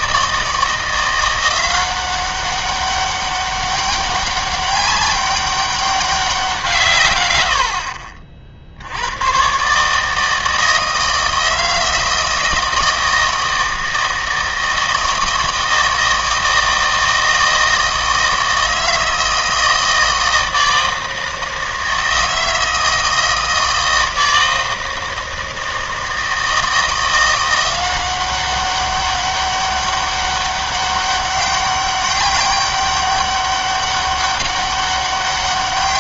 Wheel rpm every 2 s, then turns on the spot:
170, 190, 200, 160, 70, 160, 160, 160, 160, 160, 160, 160, 160, 160, 190, 200, 200, 200.
none